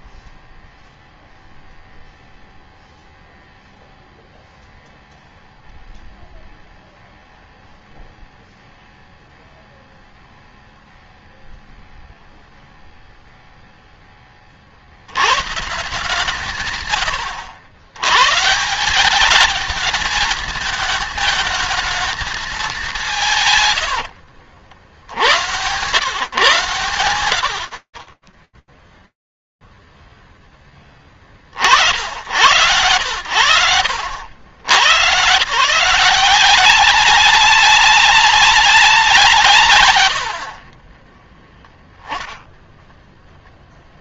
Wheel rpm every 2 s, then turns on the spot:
0, 0, 0, 0, 0, 0, 0, 30, 150, 140, 220, 210, 80, 120, 0, 60, 80, 150, 190, 120, 0, 0.
none